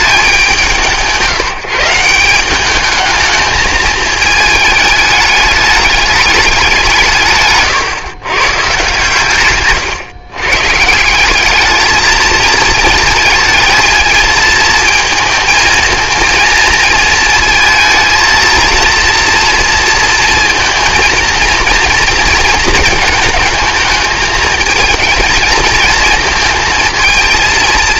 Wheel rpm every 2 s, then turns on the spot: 180, 200, 220, 190, 130, 140, 220, 230, 230, 230, 230, 220, 220, 230.
none